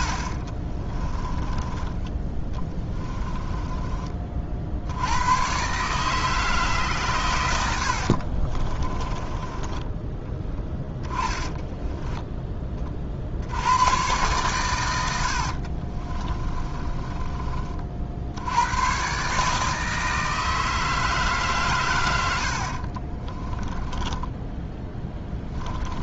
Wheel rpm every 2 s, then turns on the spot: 20, 20, 80, 140, 20, 10, 60, 80, 30, 130, 150, 30, 10.
0-4 8-12 14-18 22-26